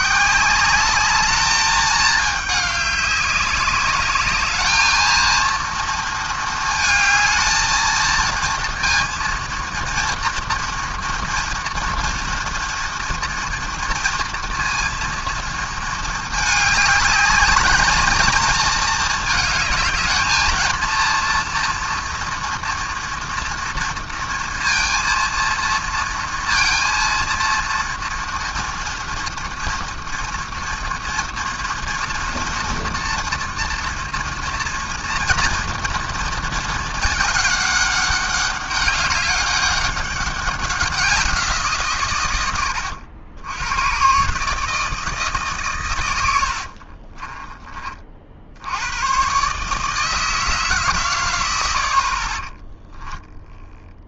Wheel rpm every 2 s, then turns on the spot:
150, 210, 200, 230, 220, 230, 230, 230, 220, 220, 220, 240, 230, 230, 230, 230, 230, 230, 230, 200, 200, 130, 120, 110, 40, 160, 60.
none